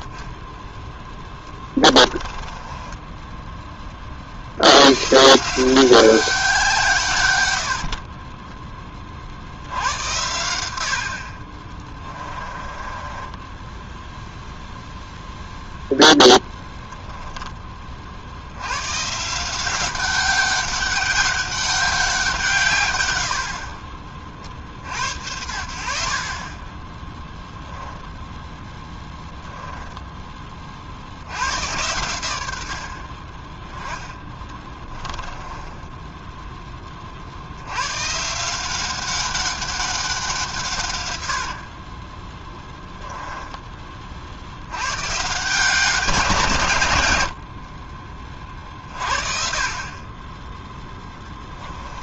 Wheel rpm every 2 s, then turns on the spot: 10, 20, 100, 160, 20, 90, 20, 0, 10, 110, 200, 140, 60, 20, 10, 40, 70, 20, 20, 180, 140, 10, 100, 140, 30, 10.
2-4 12-14 28-30 34-36 42-44 50-52